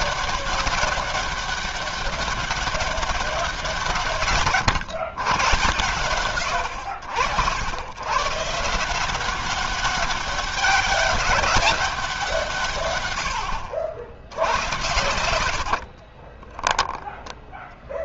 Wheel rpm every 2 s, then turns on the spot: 190, 180, 110, 80, 190, 200, 90, 80, 0.
14-16